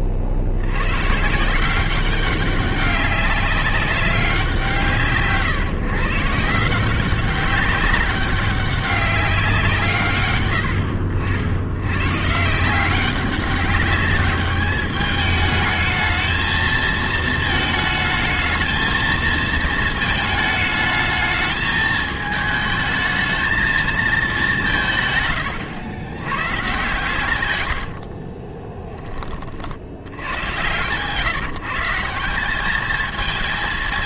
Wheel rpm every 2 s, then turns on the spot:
80, 190, 170, 170, 200, 110, 170, 210, 220, 220, 220, 220, 180, 120, 20, 110, 210.
28-30